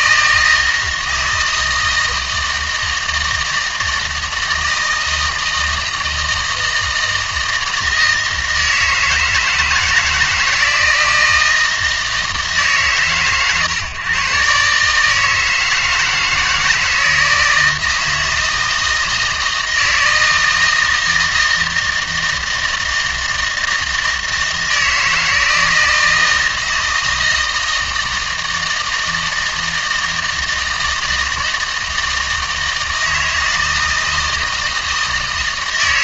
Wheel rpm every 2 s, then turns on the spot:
160, 160, 160, 160, 160, 160, 140, 140, 160, 160, 160, 160, 160, 160, 160, 160, 160, 160.
none